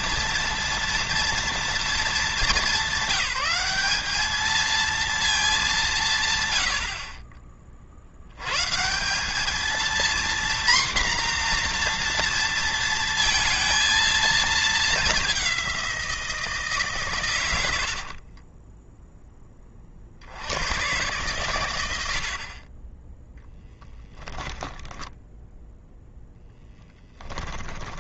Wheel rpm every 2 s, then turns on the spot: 230, 200, 220, 70, 160, 240, 230, 210, 140, 10, 100, 20, 20, 10.
18-20 24-26